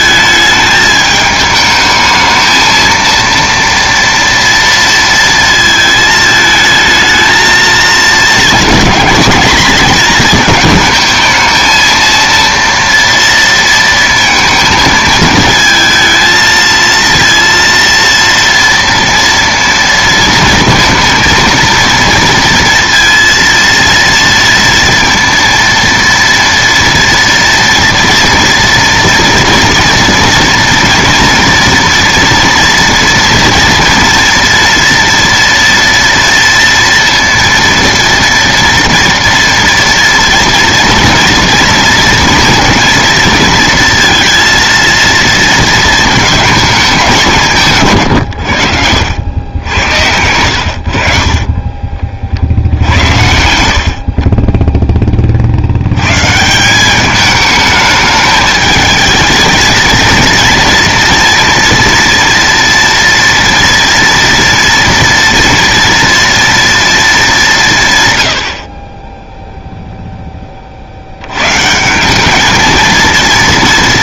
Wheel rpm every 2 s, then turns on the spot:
210, 230, 230, 220, 220, 220, 230, 220, 230, 230, 230, 230, 230, 230, 230, 230, 230, 230, 230, 230, 230, 230, 230, 210, 80, 70, 80, 20, 190, 220, 240, 230, 230, 230, 50, 20, 220.
none